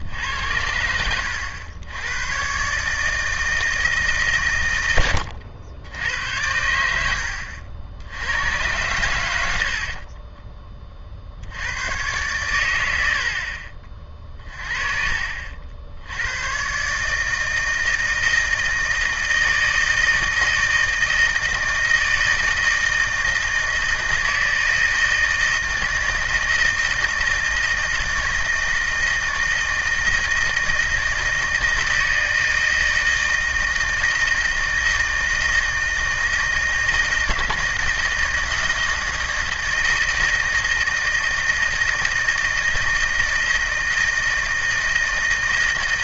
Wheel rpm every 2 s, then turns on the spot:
90, 130, 120, 90, 90, 20, 100, 30, 120, 160, 160, 160, 160, 160, 160, 160, 160, 160, 160, 160, 160, 160, 160.
none